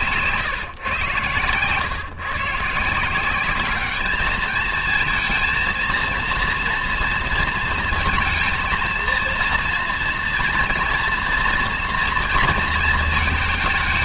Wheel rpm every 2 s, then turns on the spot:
130, 150, 220, 230, 220, 230, 220.
none